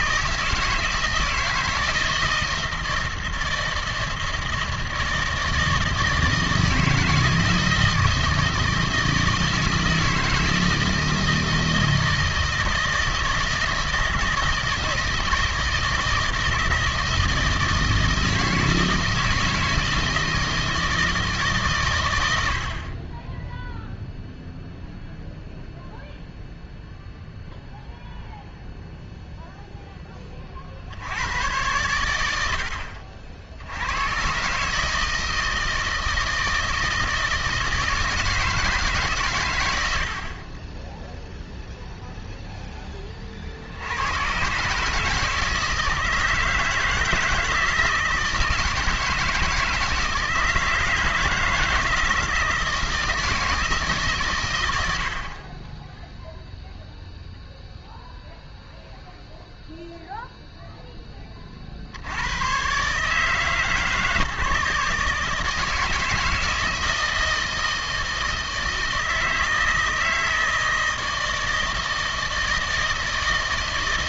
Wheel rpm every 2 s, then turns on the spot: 160, 160, 160, 160, 160, 160, 160, 160, 160, 160, 160, 70, 0, 0, 0, 40, 80, 140, 160, 160, 20, 0, 140, 160, 160, 160, 170, 110, 0, 0, 0, 130, 150, 160, 160, 160, 160.
none